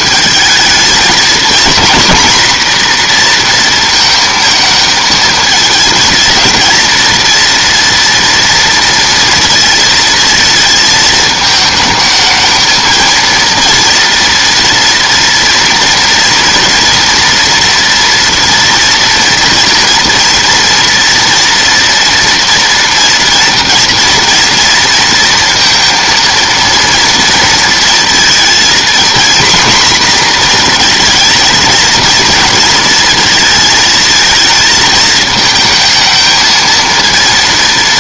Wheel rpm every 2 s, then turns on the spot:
220, 240, 220, 230, 230, 220, 220, 230, 230, 240, 230, 230, 230, 230, 230, 240, 230, 220, 220.
none